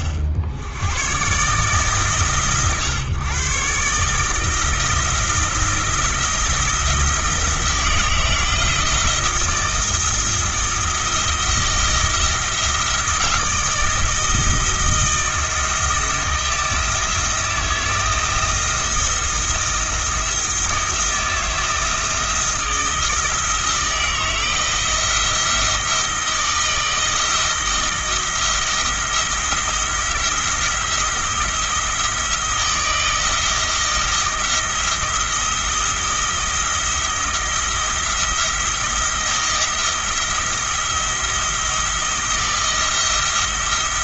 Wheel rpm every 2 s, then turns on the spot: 80, 120, 160, 170, 170, 160, 170, 160, 170, 160, 160, 170, 170, 160, 160, 170, 160, 170, 170, 170, 170, 170.
none